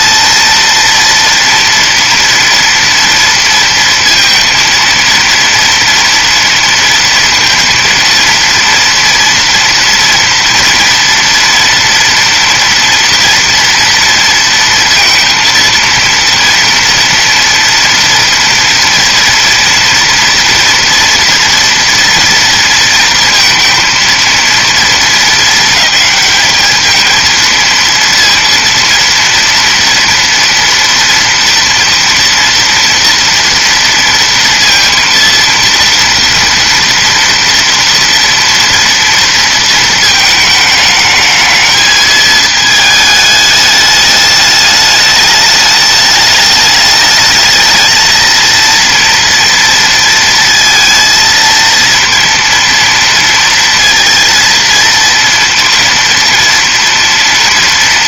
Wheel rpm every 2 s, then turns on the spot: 230, 230, 230, 230, 230, 230, 240, 230, 230, 230, 230, 230, 220, 220, 230, 230, 230, 230, 230, 230, 220, 220, 210, 210, 230, 230, 230, 230, 240.
none